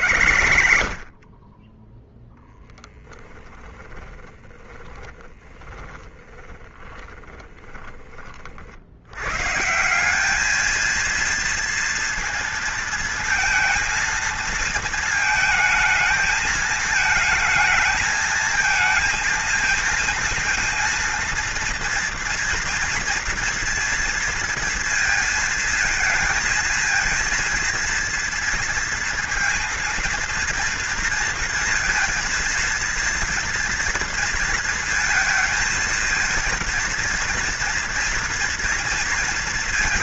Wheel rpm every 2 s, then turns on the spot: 30, 10, 10, 20, 90, 230, 230, 220, 220, 230, 230, 240, 230, 220, 230, 230, 230, 220, 230, 230.
2-8